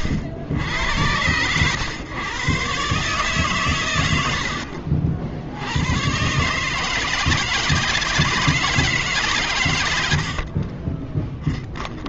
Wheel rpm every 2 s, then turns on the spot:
100, 140, 80, 150, 160, 30.
4-6 10-12